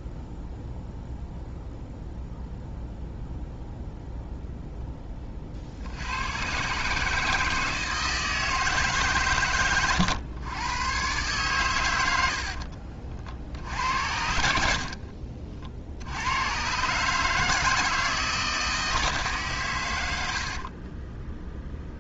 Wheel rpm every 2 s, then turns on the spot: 0, 0, 0, 130, 160, 110, 50, 60, 120, 160, 40.
12-16 20-22